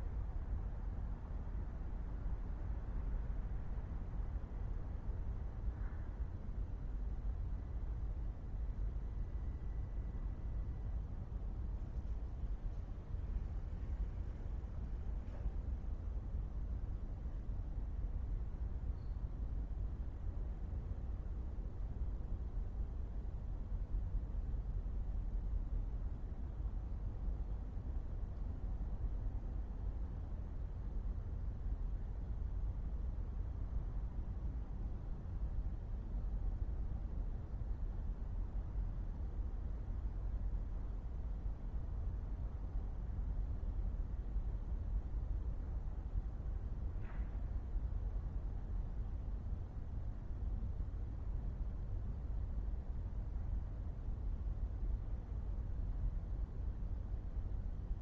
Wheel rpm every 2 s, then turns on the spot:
0, 0, 0, 0, 0, 0, 0, 0, 0, 0, 0, 0, 0, 0, 0, 0, 0, 0, 0, 0, 0, 0, 0, 0, 0, 0, 0, 0, 0.
none